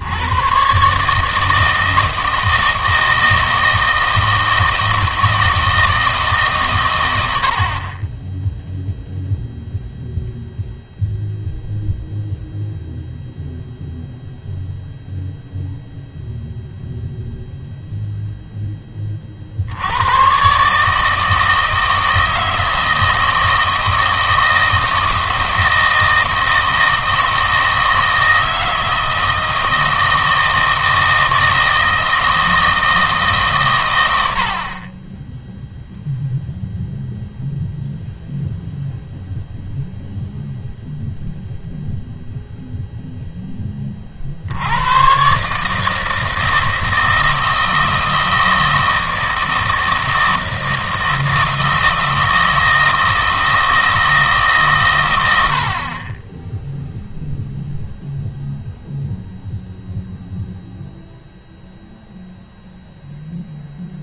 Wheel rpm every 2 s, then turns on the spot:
130, 160, 160, 130, 0, 0, 0, 0, 0, 10, 140, 160, 160, 160, 160, 160, 160, 50, 0, 0, 0, 0, 90, 160, 160, 160, 160, 140, 0, 0, 0, 0.
none